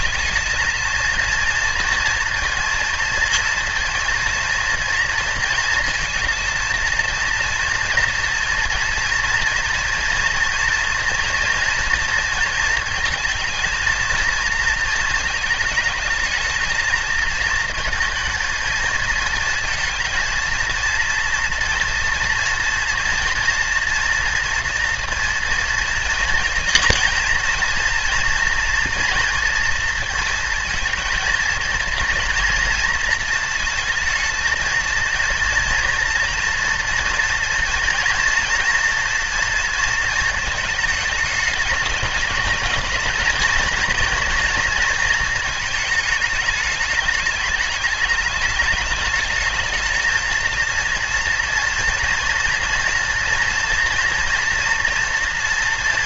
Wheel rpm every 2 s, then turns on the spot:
220, 230, 230, 230, 230, 230, 230, 230, 220, 230, 230, 230, 230, 230, 230, 230, 230, 230, 230, 230, 220, 220, 230, 210, 210, 230, 230, 230.
none